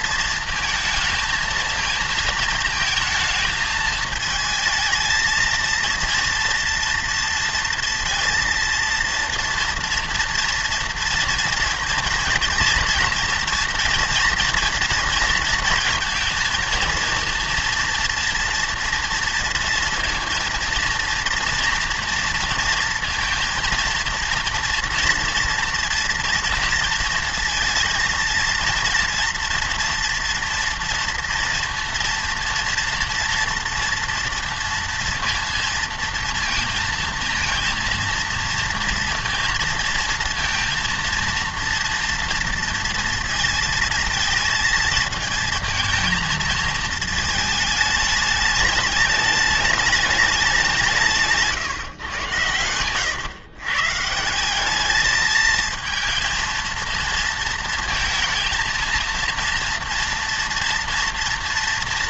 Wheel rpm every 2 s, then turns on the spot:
220, 220, 220, 230, 230, 230, 230, 230, 230, 230, 230, 230, 230, 230, 230, 230, 230, 230, 230, 230, 230, 230, 220, 220, 210, 200, 120, 200, 230, 220, 230.
52-54